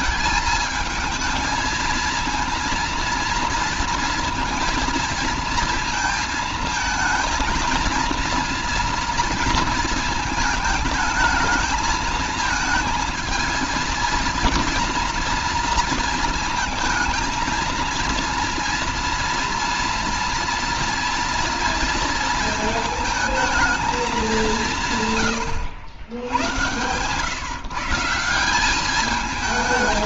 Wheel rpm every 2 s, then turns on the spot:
220, 230, 230, 230, 230, 220, 220, 230, 220, 230, 230, 220, 140, 130, 210.
none